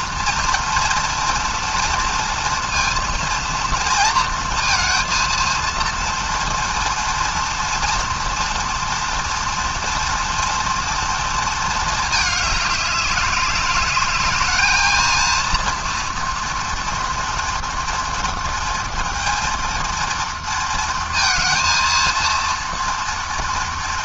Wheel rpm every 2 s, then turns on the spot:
230, 230, 230, 230, 230, 230, 210, 220, 240, 230, 230, 230.
none